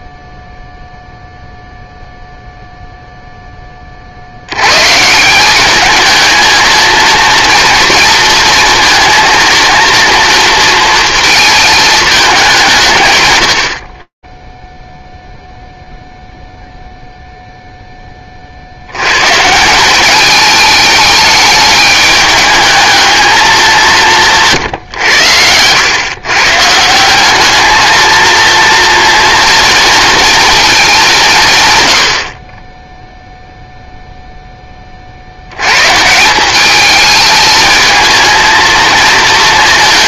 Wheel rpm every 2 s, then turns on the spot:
0, 0, 20, 200, 240, 230, 220, 50, 0, 40, 210, 210, 150, 130, 230, 230, 60, 0, 180, 230.
none